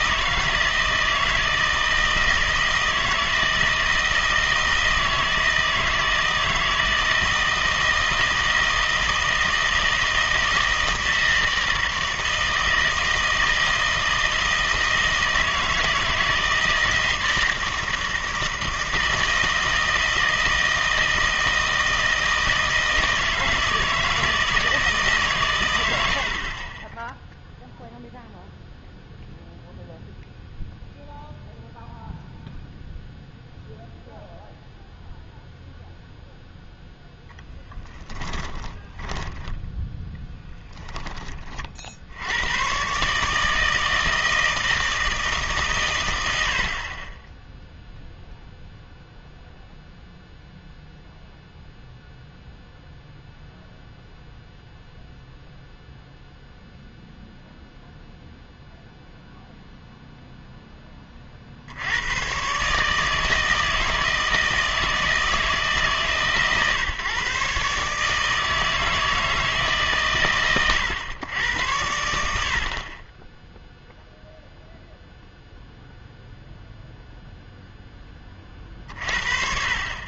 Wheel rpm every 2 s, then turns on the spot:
160, 160, 160, 160, 160, 160, 160, 160, 160, 160, 160, 160, 160, 30, 0, 0, 0, 0, 0, 20, 10, 110, 160, 60, 0, 0, 0, 0, 0, 0, 10, 140, 160, 140, 160, 120, 60, 0, 0, 40.
38-40